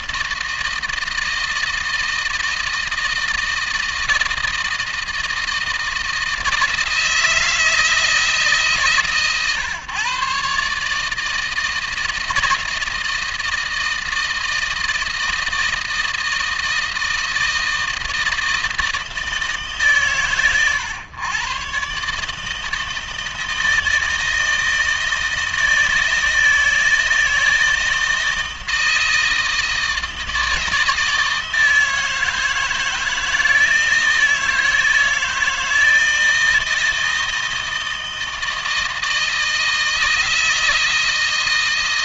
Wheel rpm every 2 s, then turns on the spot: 160, 160, 160, 160, 140, 150, 160, 160, 160, 160, 120, 160, 160, 160, 160, 160, 160, 160, 160, 160, 160.
none